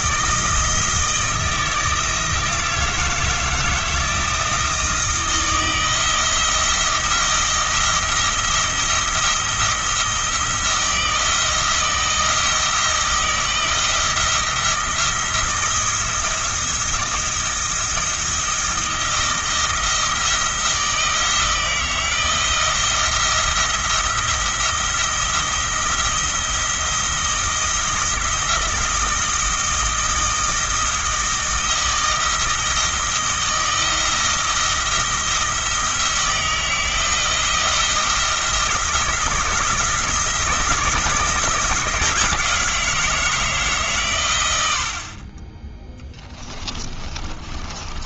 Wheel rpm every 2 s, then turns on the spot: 160, 170, 160, 170, 170, 170, 160, 170, 160, 160, 160, 160, 170, 170, 160, 160, 160, 170, 160, 170, 160, 170, 60, 20.
46-48